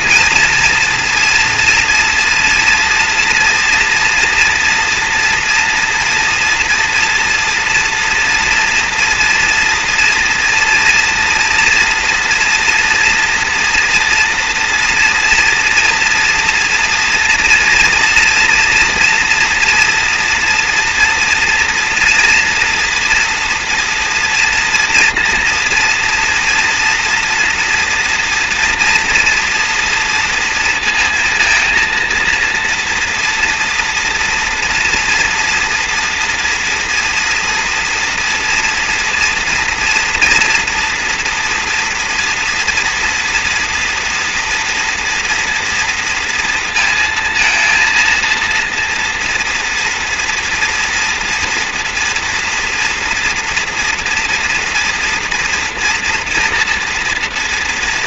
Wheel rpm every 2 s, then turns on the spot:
240, 240, 230, 230, 230, 230, 230, 230, 230, 230, 230, 230, 230, 240, 240, 230, 230, 230, 230, 230, 230, 240, 230, 230, 230, 230, 240, 230, 230.
none